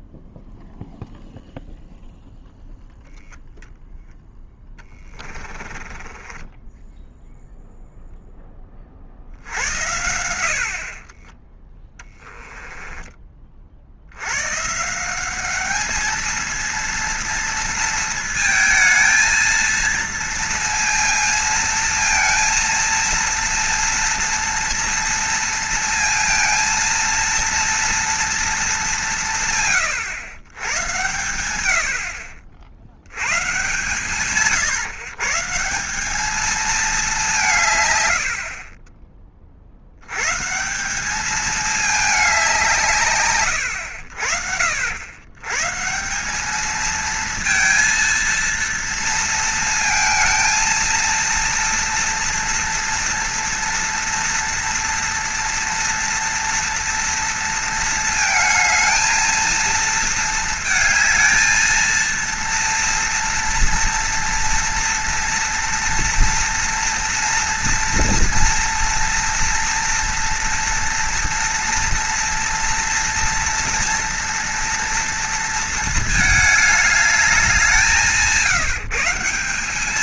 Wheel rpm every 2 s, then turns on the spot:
0, 0, 10, 10, 10, 70, 10, 130, 230, 230, 230, 230, 230, 230, 220, 110, 60, 130, 220, 60, 160, 180, 70, 220, 230, 230, 230, 230, 230, 220, 220, 230, 230, 230, 230, 230, 230, 230, 210, 160.
6-8 12-14